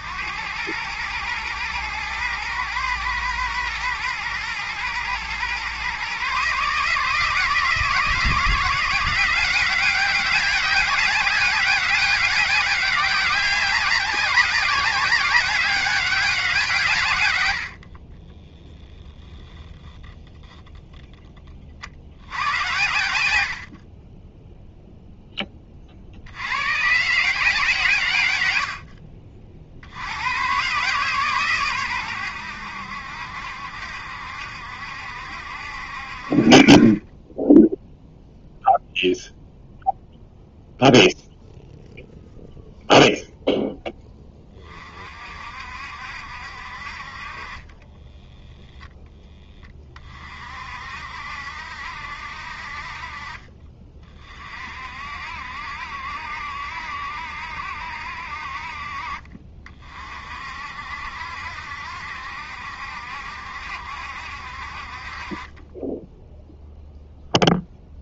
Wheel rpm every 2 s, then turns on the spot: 110, 110, 120, 150, 170, 200, 200, 190, 150, 0, 0, 90, 0, 120, 80, 130, 80, 70, 40, 0, 0, 0, 30, 50, 10, 50, 50, 50, 70, 60, 60, 70, 50, 0.
22-24